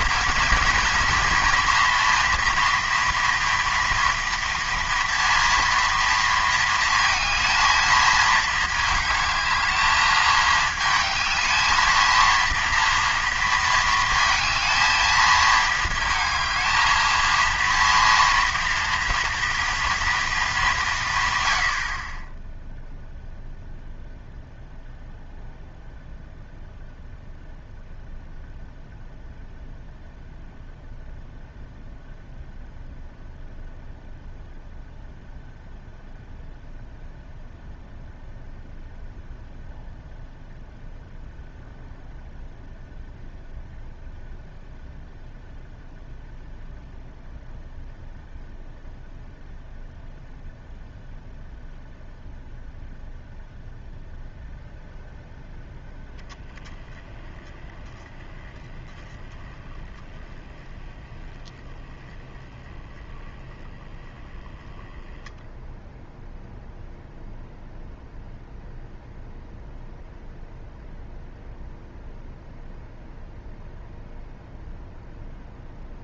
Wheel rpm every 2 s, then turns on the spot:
230, 240, 230, 220, 220, 220, 230, 220, 230, 230, 130, 0, 0, 0, 0, 0, 0, 0, 0, 0, 0, 0, 0, 0, 0, 0, 0, 0, 20, 10, 10, 10, 10, 0, 0, 0, 0, 0.
none